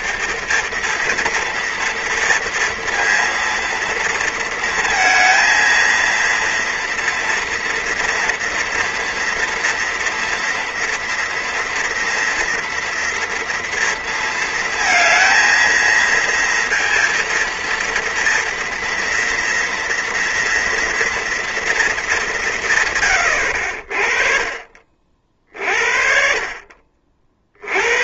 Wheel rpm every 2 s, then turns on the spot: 220, 230, 230, 230, 230, 230, 230, 230, 230, 230, 230, 130, 40, 50.
none